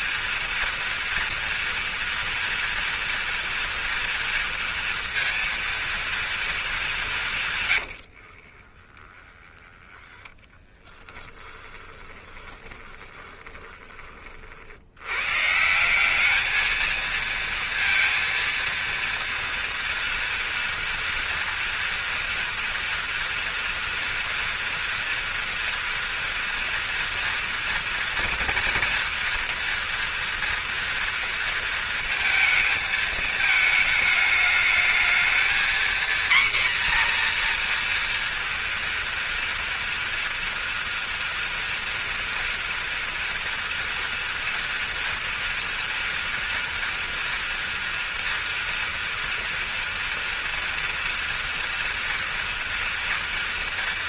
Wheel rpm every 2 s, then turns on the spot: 230, 230, 230, 230, 60, 10, 20, 40, 210, 230, 230, 240, 230, 230, 230, 230, 230, 220, 240, 230, 230, 240, 230, 230, 230, 230, 230.
8-10 12-14